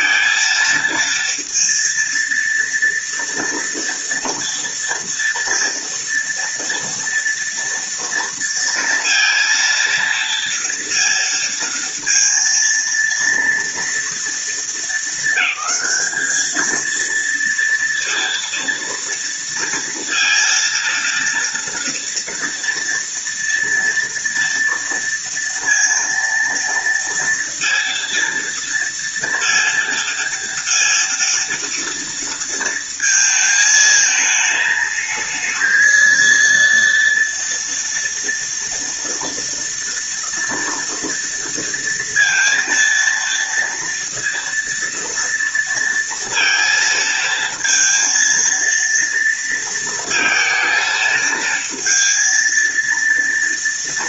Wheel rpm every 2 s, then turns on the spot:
230, 230, 230, 230, 230, 230, 230, 220, 230, 230, 230, 230, 230, 230, 230, 230, 220, 220, 230, 230, 230, 230, 230, 230, 230, 220, 230.
none